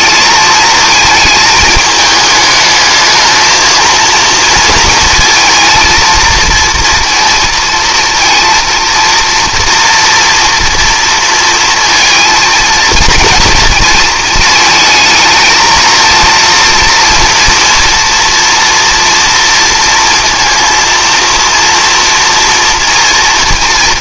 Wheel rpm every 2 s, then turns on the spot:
220, 220, 230, 230, 230, 230, 230, 220, 230, 230, 230, 230.
none